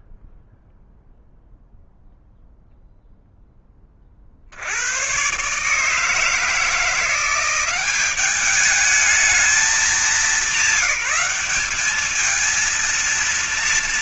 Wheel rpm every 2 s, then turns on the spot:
0, 0, 50, 160, 200, 200, 210.
none